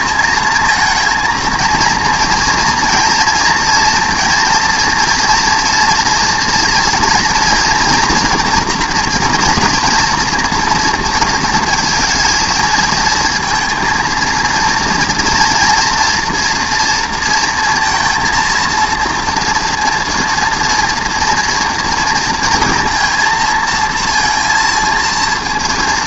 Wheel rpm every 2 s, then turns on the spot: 220, 230, 240, 230, 240, 230, 220, 230, 240, 230, 230, 230, 230.
none